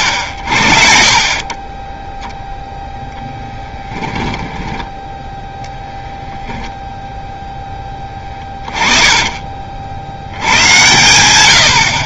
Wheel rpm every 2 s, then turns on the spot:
50, 0, 10, 0, 20, 100.
4-6 8-10